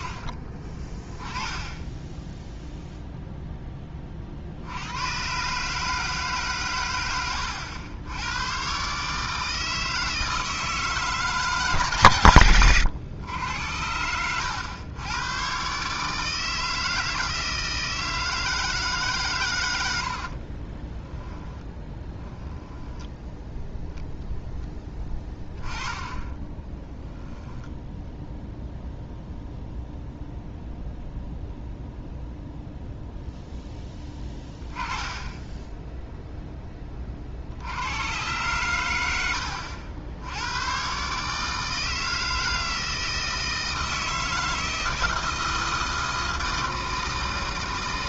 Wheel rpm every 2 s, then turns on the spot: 20, 0, 80, 120, 130, 160, 110, 100, 160, 160, 30, 10, 10, 10, 0, 0, 0, 10, 20, 110, 120, 160, 160, 160.
20-28